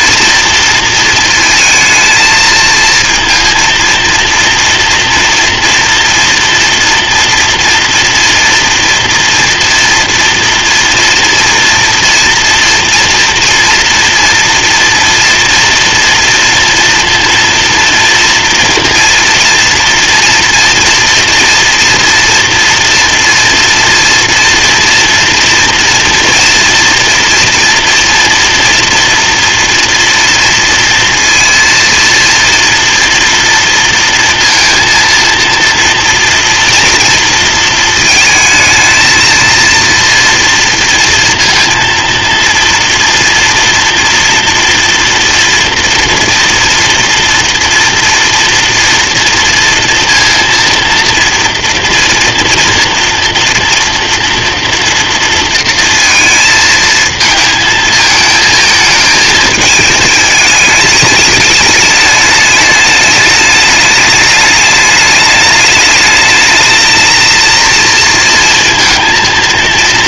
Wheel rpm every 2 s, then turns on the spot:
230, 220, 230, 230, 230, 230, 230, 230, 230, 230, 230, 240, 230, 230, 240, 230, 230, 230, 230, 220, 230, 230, 230, 230, 230, 230, 230, 230, 220, 220, 220, 210, 210, 220, 230.
none